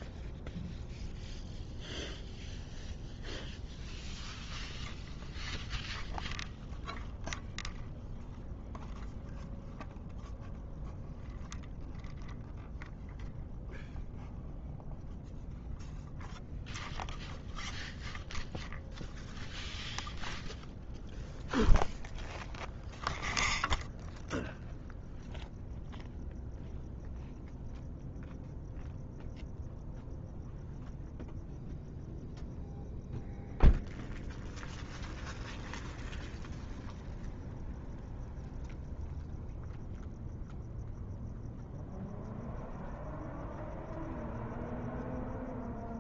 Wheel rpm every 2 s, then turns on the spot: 0, 0, 0, 0, 0, 0, 0, 0, 0, 0, 0, 0, 0, 0, 0, 0, 0, 0, 0, 0, 0, 0, 0.
none